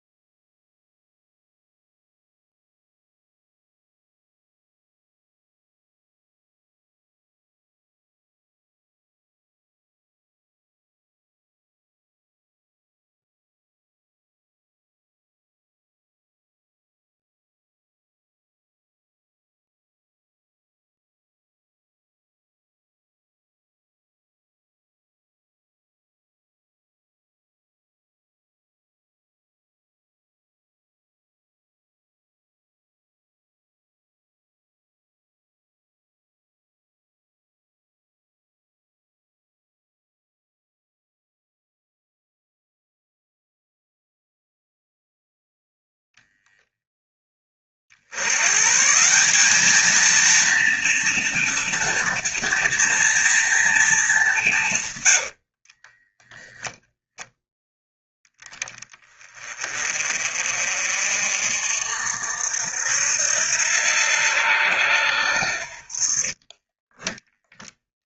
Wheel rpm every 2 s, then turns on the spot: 0, 0, 0, 0, 0, 0, 0, 0, 0, 0, 0, 0, 0, 0, 0, 0, 0, 0, 0, 0, 0, 0, 0, 0, 140, 230, 230, 160, 0, 10, 50, 70, 80, 20.
54-56 66-68